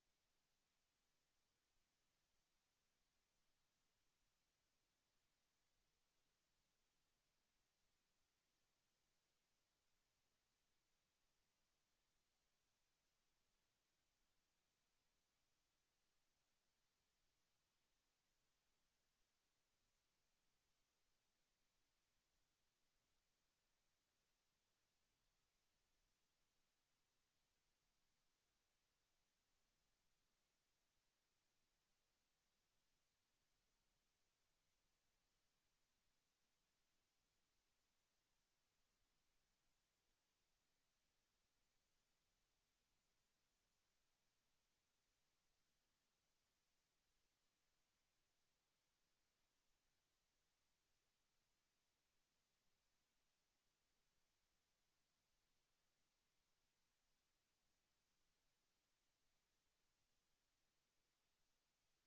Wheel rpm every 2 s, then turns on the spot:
0, 0, 0, 0, 0, 0, 0, 0, 0, 0, 0, 0, 0, 0, 0, 0, 0, 0, 0, 0, 0, 0, 0, 0, 0, 0, 0, 0, 0, 0, 0.
none